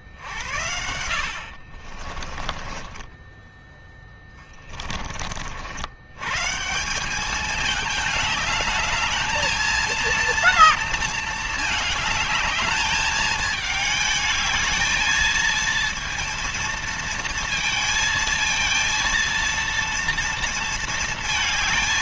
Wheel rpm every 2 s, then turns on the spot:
70, 20, 40, 180, 220, 230, 210, 220, 230, 230, 230.
0-4